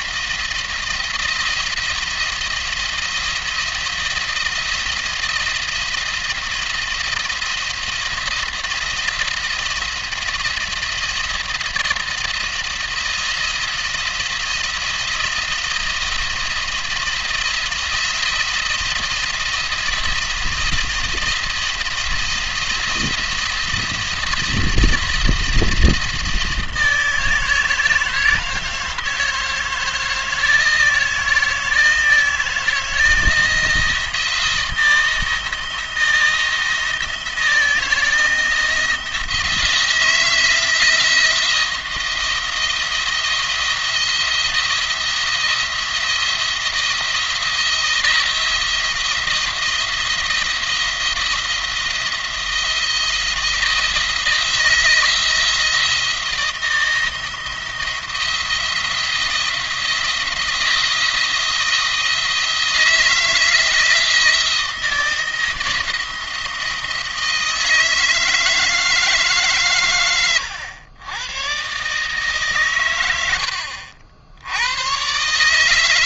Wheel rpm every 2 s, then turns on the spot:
170, 170, 170, 170, 170, 170, 170, 170, 170, 170, 170, 170, 170, 160, 160, 160, 160, 160, 170, 170, 170, 170, 170, 170, 170, 170, 170, 170, 160, 170, 170, 160, 170, 170, 160, 100, 120, 100.
none